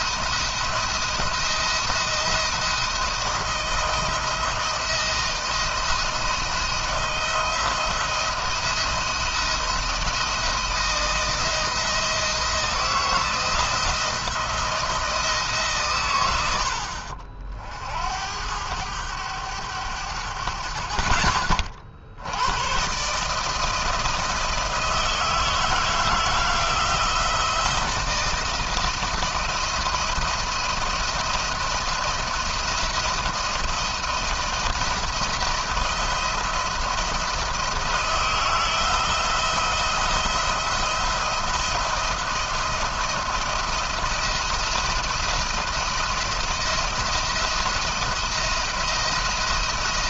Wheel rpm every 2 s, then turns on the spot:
160, 160, 170, 160, 170, 170, 170, 170, 60, 100, 60, 130, 160, 160, 160, 170, 170, 170, 170, 160, 170, 170, 170, 170, 170.
none